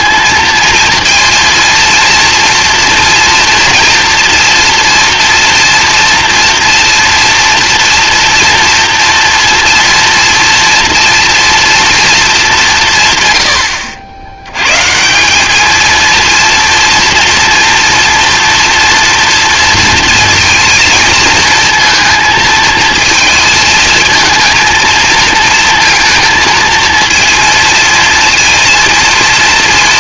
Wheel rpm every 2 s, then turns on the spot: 230, 230, 230, 240, 230, 240, 190, 110, 230, 230, 230, 220, 230, 230, 230.
none